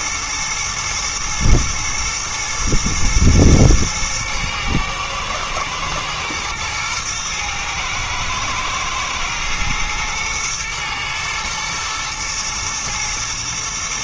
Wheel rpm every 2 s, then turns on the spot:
120, 110, 110, 110, 110, 110, 110.
none